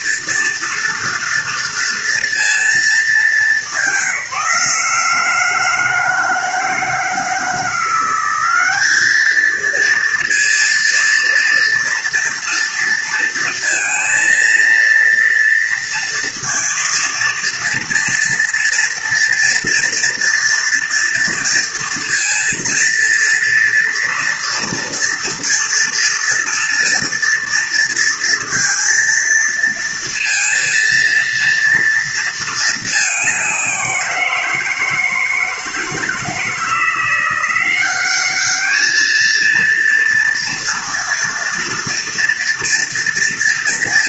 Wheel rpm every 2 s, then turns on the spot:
230, 210, 160, 160, 210, 230, 230, 230, 230, 230, 230, 230, 230, 230, 230, 230, 210, 160, 170, 220, 230, 230.
none